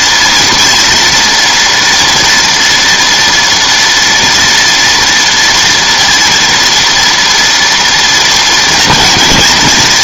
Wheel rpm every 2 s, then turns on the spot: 230, 230, 240, 240, 230.
none